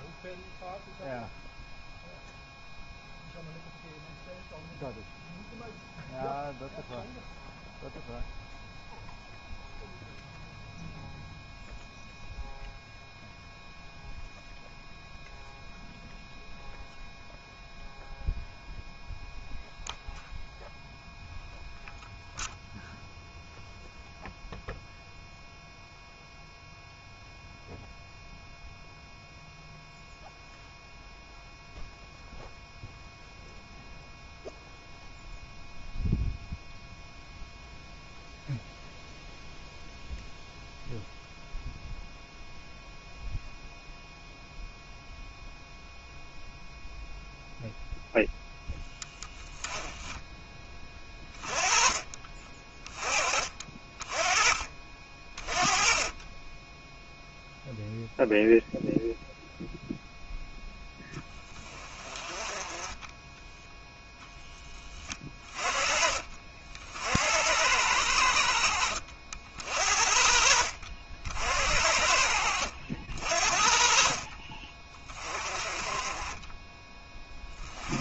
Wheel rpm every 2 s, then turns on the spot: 0, 0, 0, 0, 0, 0, 0, 0, 0, 0, 0, 0, 0, 0, 0, 0, 0, 0, 0, 0, 0, 0, 0, 0, 10, 10, 30, 30, 10, 0, 10, 20, 10, 50, 60, 60, 60, 30, 20.
52-54 56-58